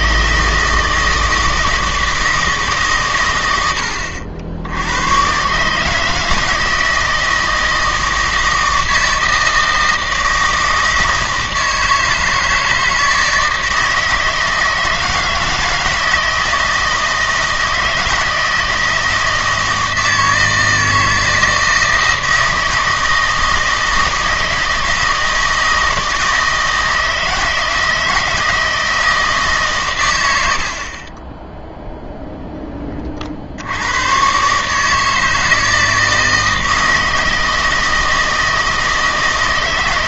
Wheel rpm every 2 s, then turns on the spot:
160, 150, 80, 160, 160, 160, 160, 160, 160, 160, 160, 160, 160, 160, 160, 60, 20, 150, 160, 160.
none